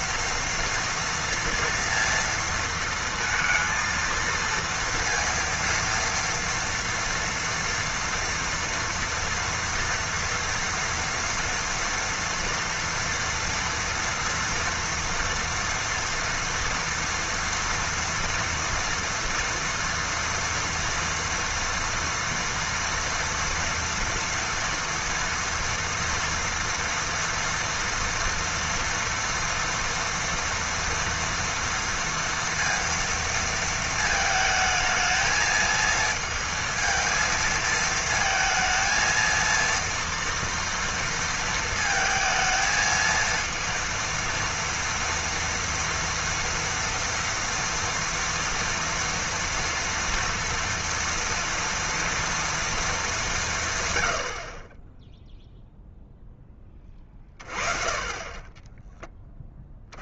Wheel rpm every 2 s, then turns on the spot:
230, 230, 230, 230, 230, 230, 230, 230, 240, 240, 230, 230, 230, 230, 230, 240, 230, 220, 220, 220, 230, 220, 230, 230, 230, 230, 230, 40, 20, 20.
none